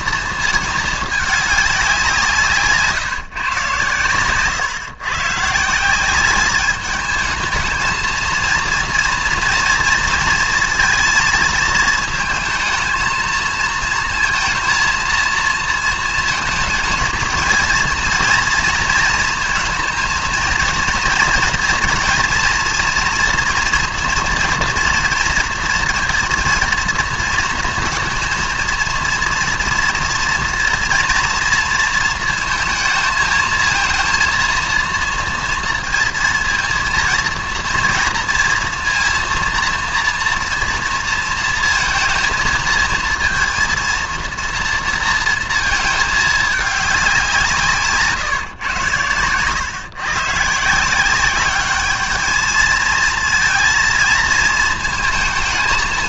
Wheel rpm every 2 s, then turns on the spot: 220, 160, 130, 200, 230, 230, 220, 230, 220, 230, 230, 240, 230, 230, 230, 230, 230, 230, 230, 230, 230, 230, 230, 210, 120, 160, 220, 220.
none